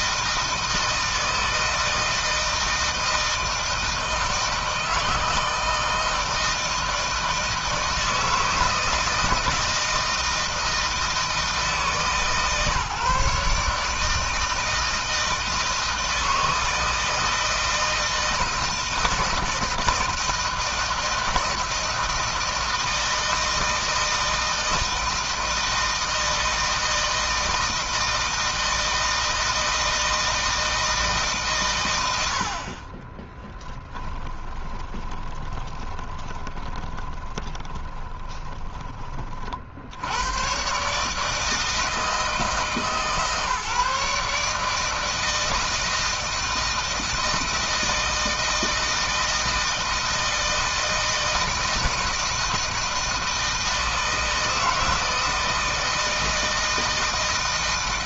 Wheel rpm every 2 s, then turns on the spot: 160, 160, 160, 160, 160, 160, 150, 160, 160, 160, 160, 160, 160, 160, 160, 160, 30, 20, 20, 30, 140, 150, 160, 160, 160, 160, 160, 160, 160.
32-38